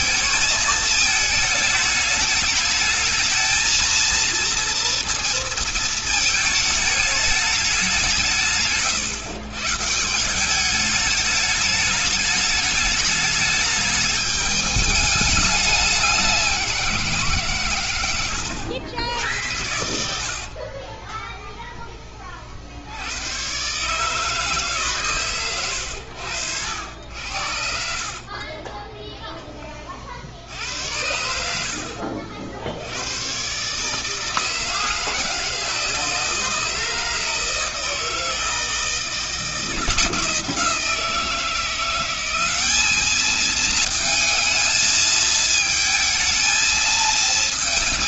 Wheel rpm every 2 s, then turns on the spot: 220, 220, 230, 210, 140, 200, 210, 210, 180, 90, 40, 70, 150, 90, 20, 80, 80, 160, 160, 160, 160, 200, 220, 230.
20-22 28-30